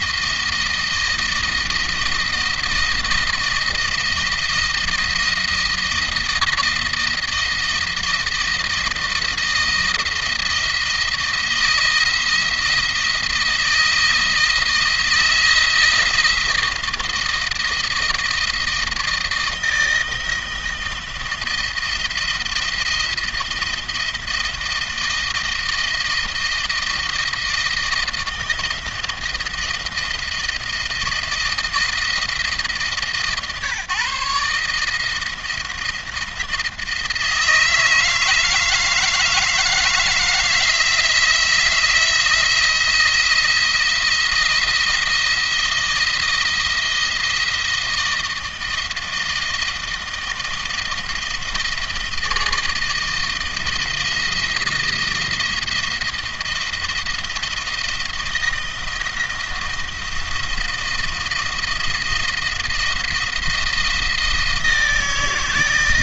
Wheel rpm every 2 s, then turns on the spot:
160, 170, 170, 160, 170, 160, 170, 160, 160, 160, 160, 170, 170, 160, 160, 160, 160, 150, 170, 160, 170, 170, 170, 170, 160, 170, 160, 170, 160, 170, 170, 170, 160.
none